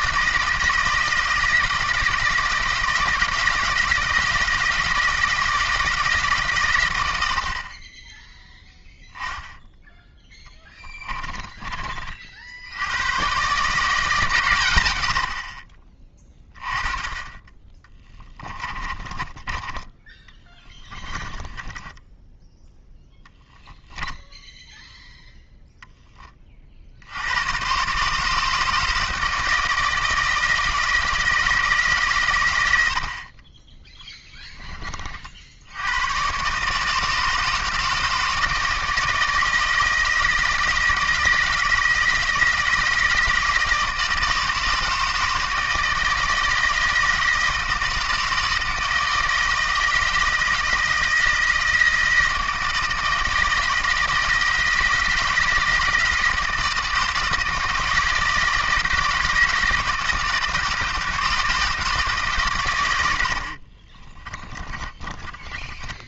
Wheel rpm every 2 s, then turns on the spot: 160, 160, 160, 130, 0, 10, 80, 110, 20, 30, 20, 10, 0, 50, 160, 160, 80, 30, 150, 160, 160, 160, 160, 160, 160, 160, 160, 160, 160, 160, 160, 100, 20.
10-12 18-22 64-66